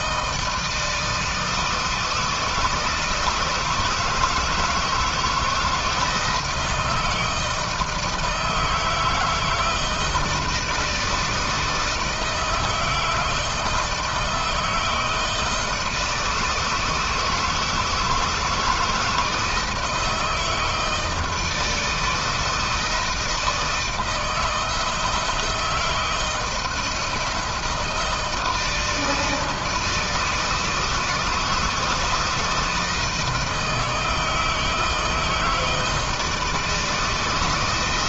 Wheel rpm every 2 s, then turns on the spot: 160, 160, 160, 160, 160, 160, 160, 160, 160, 160, 160, 160, 160, 170, 160, 160, 160, 160, 160.
none